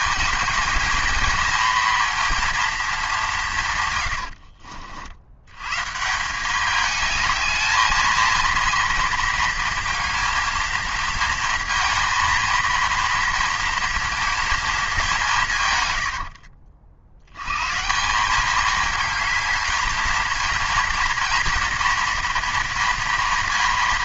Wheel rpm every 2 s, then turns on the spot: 220, 220, 60, 210, 230, 220, 230, 220, 60, 210, 230, 230.
none